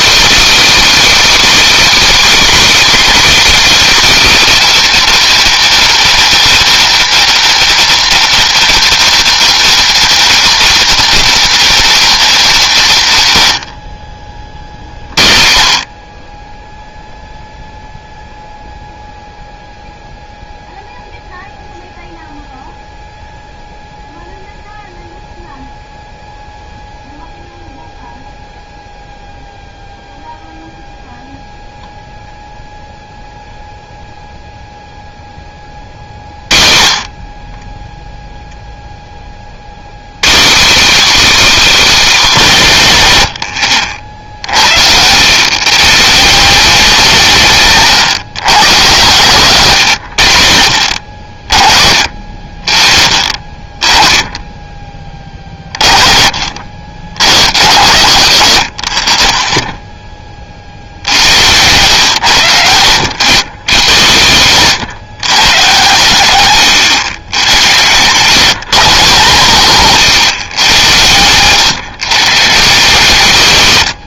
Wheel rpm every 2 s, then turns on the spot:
340, 330, 350, 360, 350, 350, 230, 80, 0, 0, 0, 0, 0, 0, 0, 0, 0, 0, 40, 10, 290, 150, 80, 180, 130, 80, 30, 30, 70, 40, 60, 120, 140, 110, 170, 110, 160.
62-64